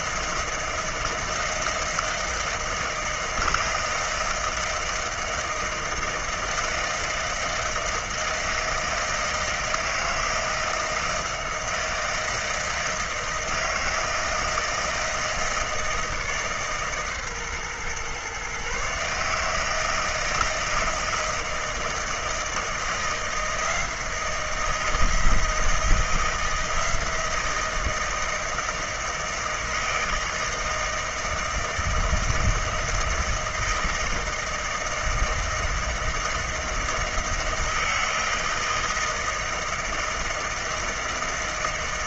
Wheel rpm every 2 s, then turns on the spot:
160, 160, 160, 160, 160, 160, 160, 160, 150, 140, 160, 160, 160, 170, 160, 160, 160, 160, 160, 160, 160.
none